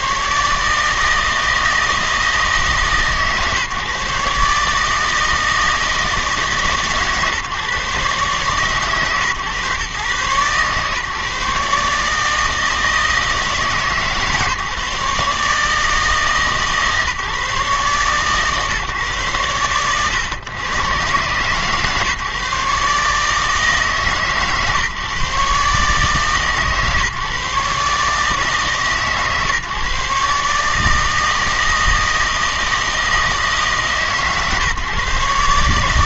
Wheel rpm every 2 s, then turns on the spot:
150, 150, 150, 150, 130, 140, 160, 150, 150, 130, 120, 140, 140, 140, 140, 150, 160, 140.
none